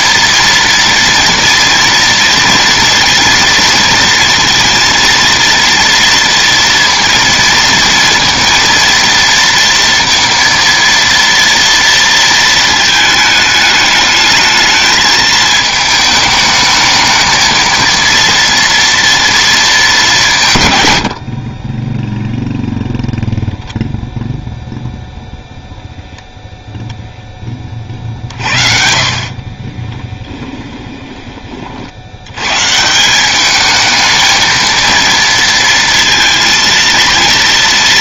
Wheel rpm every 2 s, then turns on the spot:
230, 230, 230, 230, 230, 230, 230, 220, 220, 230, 170, 0, 0, 0, 50, 20, 110, 220, 230.
30-32